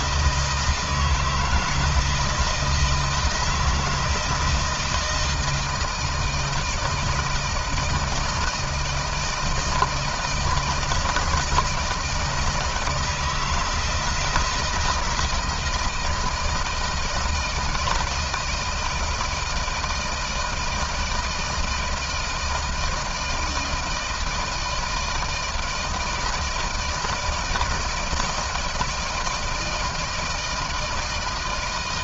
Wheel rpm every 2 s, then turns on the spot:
160, 160, 170, 160, 160, 160, 160, 160, 160, 160, 160, 160, 160, 160, 160, 160.
none